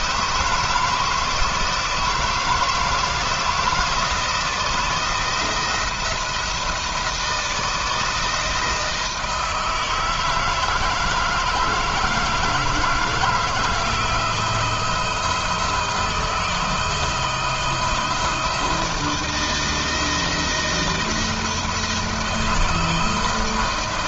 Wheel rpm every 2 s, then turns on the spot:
160, 160, 170, 160, 160, 160, 160, 170, 160, 160, 170, 160.
none